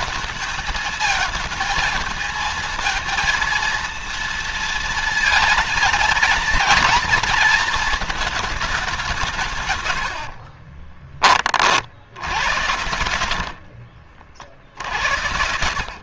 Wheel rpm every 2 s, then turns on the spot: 220, 230, 230, 230, 190, 40, 90, 70.
10-16